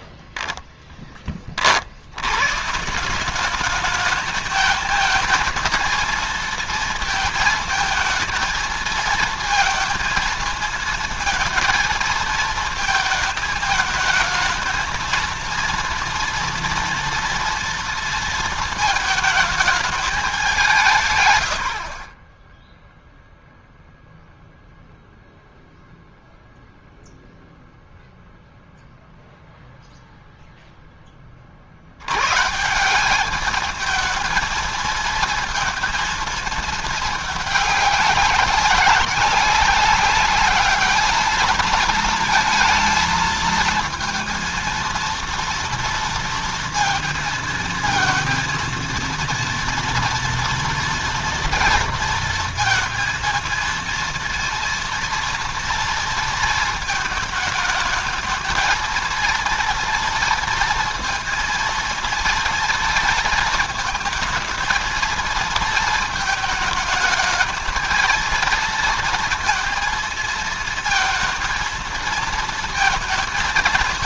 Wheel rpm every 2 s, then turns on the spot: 10, 160, 220, 230, 220, 230, 220, 220, 230, 220, 160, 0, 0, 0, 0, 10, 170, 220, 220, 190, 210, 220, 230, 230, 230, 230, 230, 230, 220, 220, 230, 230, 220, 220, 230, 230, 220.
20-22